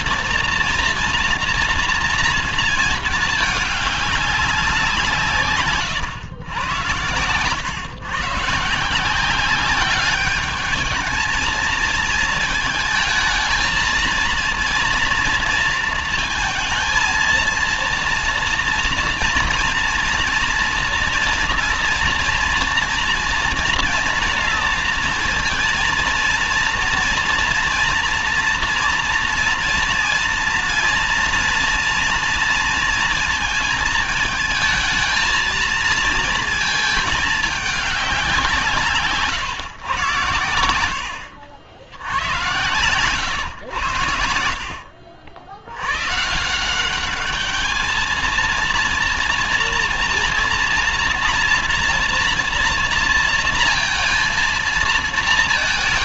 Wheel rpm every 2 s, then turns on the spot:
230, 220, 190, 100, 150, 210, 220, 230, 230, 230, 230, 230, 230, 230, 230, 230, 230, 220, 220, 180, 110, 110, 70, 160, 230, 230, 230, 220.
none